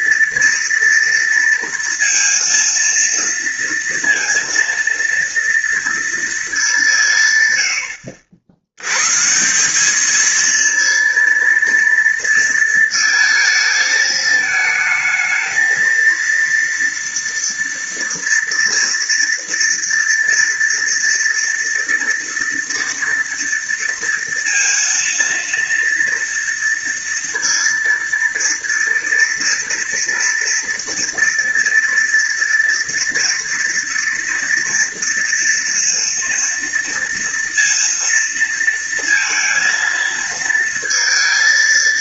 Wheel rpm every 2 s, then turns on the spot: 230, 230, 230, 150, 140, 230, 230, 220, 230, 230, 230, 230, 230, 230, 230, 230, 230, 230, 230, 230, 230.
none